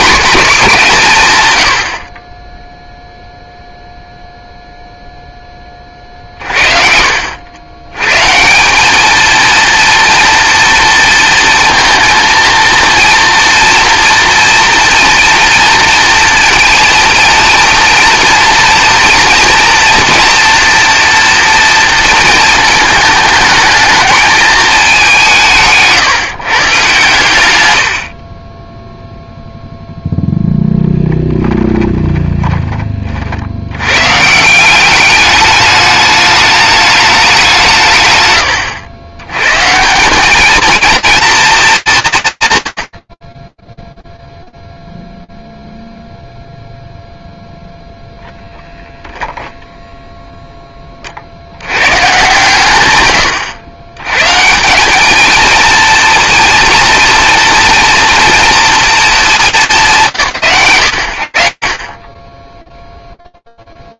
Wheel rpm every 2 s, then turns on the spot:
180, 0, 0, 50, 200, 230, 230, 230, 230, 230, 230, 220, 210, 130, 10, 10, 30, 190, 210, 110, 230, 90, 0, 0, 0, 50, 120, 220, 230, 230, 70, 0.
none